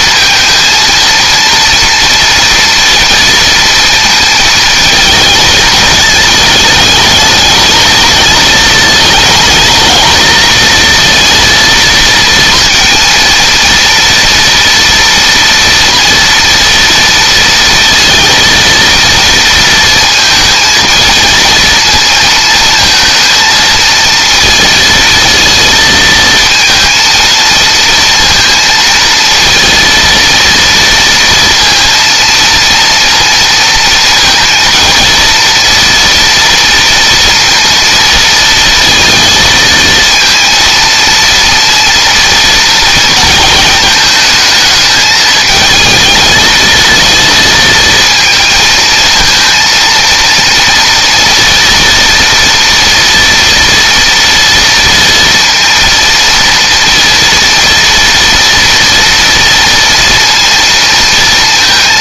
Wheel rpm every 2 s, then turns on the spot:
230, 230, 220, 210, 220, 230, 230, 230, 230, 230, 220, 230, 230, 230, 230, 230, 230, 230, 230, 230, 230, 230, 220, 220, 230, 240, 230, 230, 230, 230, 230.
none